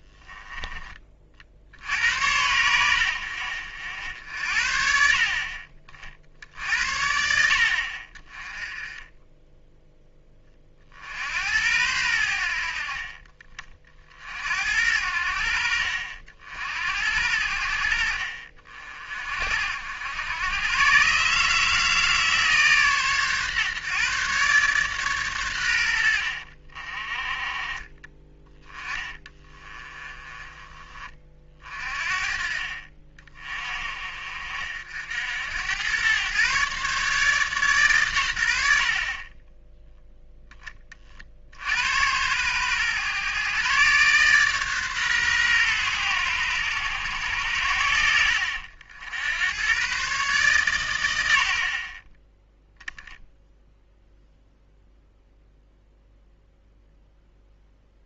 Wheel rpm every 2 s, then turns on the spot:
20, 80, 60, 70, 20, 30, 60, 70, 60, 50, 110, 140, 130, 50, 20, 30, 40, 60, 130, 70, 20, 110, 140, 110, 80, 130, 10, 0, 0.
28-30